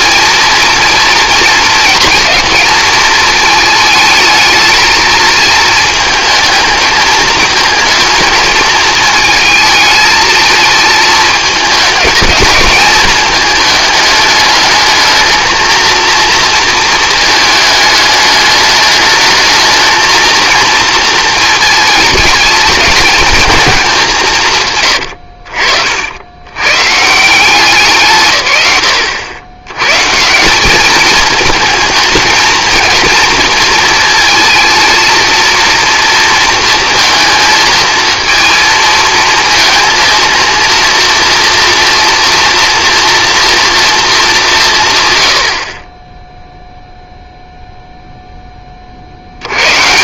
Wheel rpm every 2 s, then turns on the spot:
230, 220, 220, 220, 220, 220, 220, 220, 220, 210, 230, 210, 120, 130, 110, 200, 220, 230, 230, 220, 230, 230, 140, 0, 20.
24-26